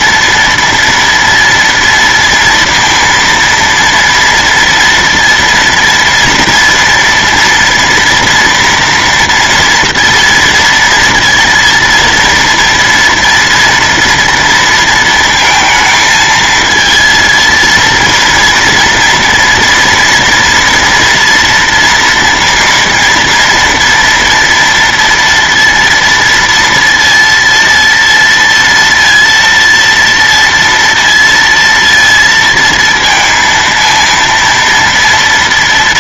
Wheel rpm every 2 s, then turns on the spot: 230, 230, 230, 230, 240, 230, 230, 230, 220, 230, 230, 230, 230, 230, 230, 230, 230, 230.
none